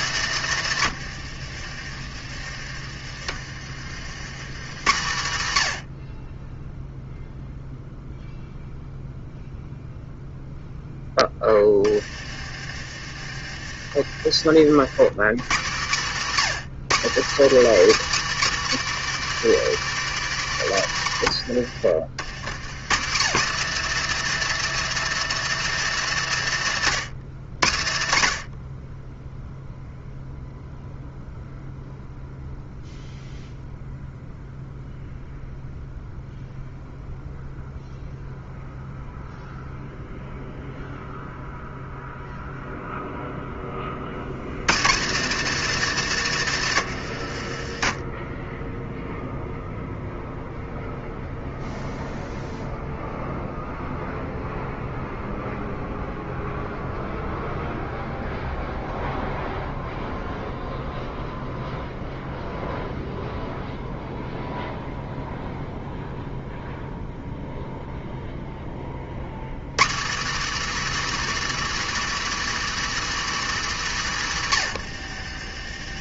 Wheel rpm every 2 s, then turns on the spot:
180, 70, 140, 0, 0, 10, 70, 120, 240, 330, 160, 160, 350, 230, 50, 0, 0, 0, 0, 0, 0, 0, 270, 190, 0, 0, 0, 0, 0, 0, 0, 0, 0, 0, 60, 350, 350, 120.
0-4 10-14 46-48 74-76